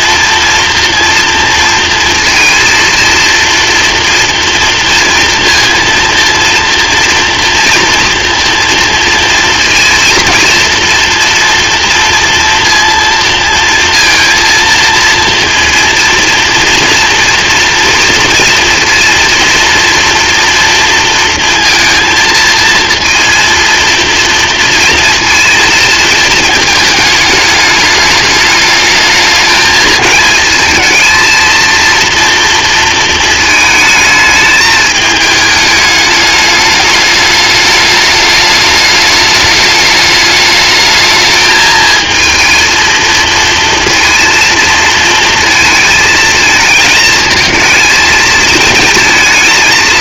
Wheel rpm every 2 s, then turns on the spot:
240, 230, 230, 230, 230, 230, 230, 230, 230, 240, 230, 230, 230, 220, 220, 220, 230, 220, 210, 210, 210, 230, 230, 220, 220.
none